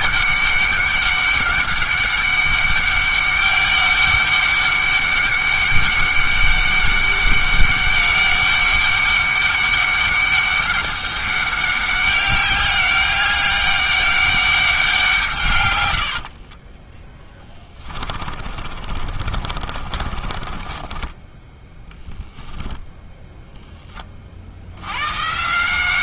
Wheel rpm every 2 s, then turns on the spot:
200, 200, 200, 200, 200, 200, 200, 190, 20, 40, 20, 0, 80.
16-22